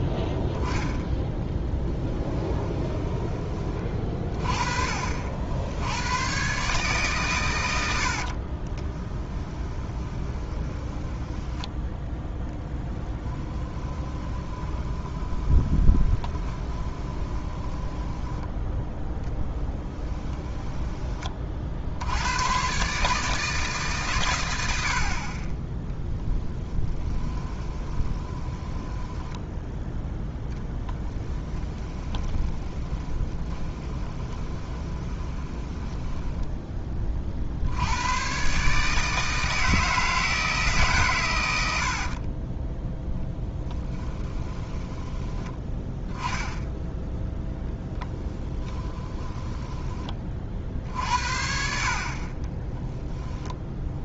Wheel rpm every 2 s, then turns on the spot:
0, 20, 40, 140, 30, 10, 10, 20, 20, 10, 20, 130, 70, 10, 10, 10, 30, 20, 20, 140, 140, 10, 10, 10, 10, 50, 20.
2-4 8-18 20-22 26-36 42-46 48-50 52-54